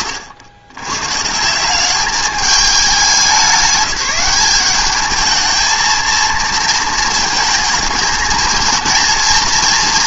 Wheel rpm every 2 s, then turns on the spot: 100, 200, 210, 220, 220.
none